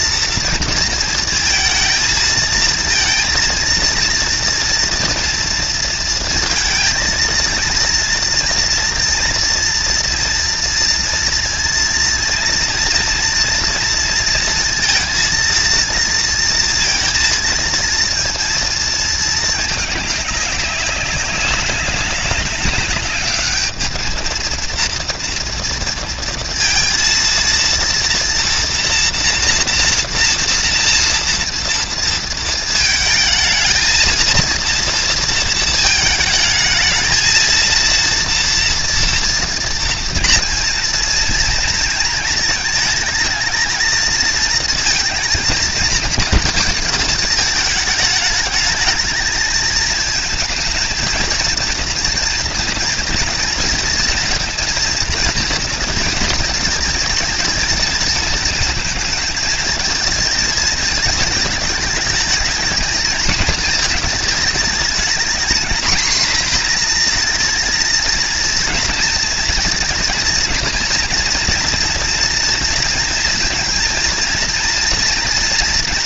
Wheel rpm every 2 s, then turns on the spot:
230, 230, 230, 230, 230, 230, 230, 230, 230, 220, 190, 200, 230, 230, 230, 230, 220, 230, 220, 230, 230, 220, 220, 220, 210, 220, 230, 230, 220, 230, 220, 220, 220, 230, 230, 230, 230, 230.
none